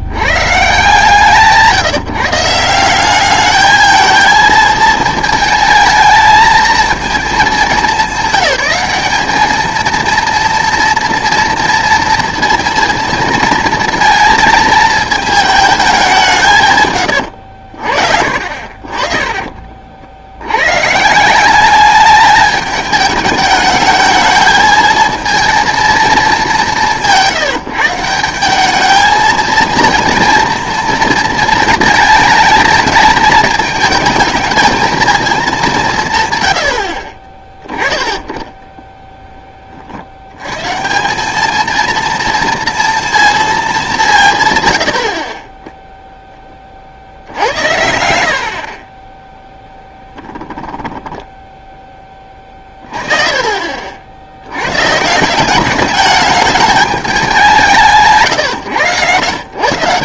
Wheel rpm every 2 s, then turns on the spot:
140, 170, 220, 220, 200, 230, 230, 220, 140, 50, 110, 210, 220, 190, 190, 230, 220, 220, 110, 20, 110, 240, 110, 20, 50, 10, 30, 50, 210, 120.
44-46 50-54